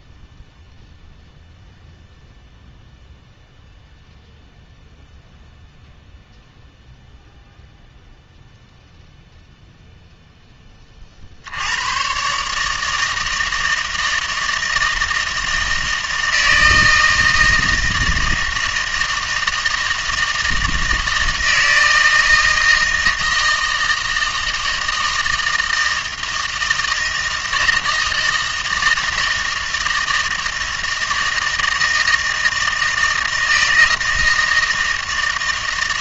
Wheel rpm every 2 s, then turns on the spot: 0, 0, 0, 0, 0, 20, 150, 160, 160, 160, 160, 160, 160, 160, 160, 160, 160, 160.
none